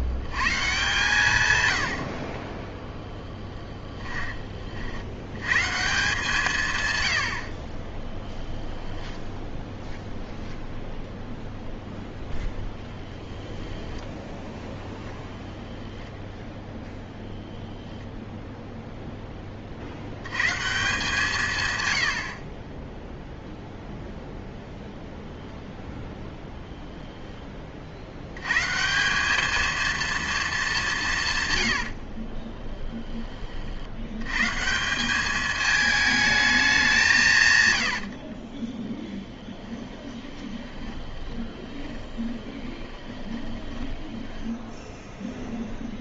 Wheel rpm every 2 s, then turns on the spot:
140, 10, 40, 140, 10, 0, 0, 0, 0, 0, 150, 20, 0, 10, 140, 210, 10, 170, 190, 20, 20, 20, 0.
2-4 22-24 26-28 32-34 38-44